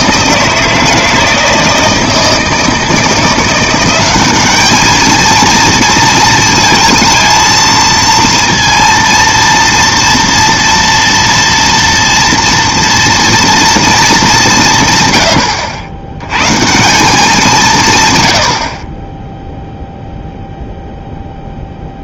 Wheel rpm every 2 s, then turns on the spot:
160, 160, 210, 230, 230, 230, 230, 160, 150, 40, 0.
none